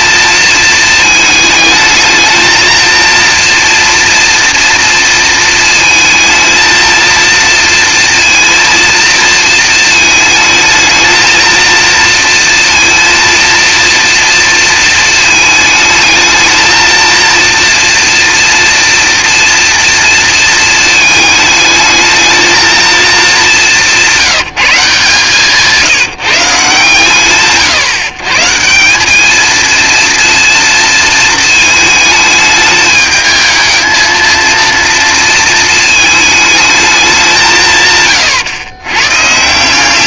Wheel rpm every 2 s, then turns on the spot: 230, 230, 230, 230, 230, 220, 230, 230, 220, 230, 220, 220, 180, 150, 180, 230, 210, 230, 210, 120.
none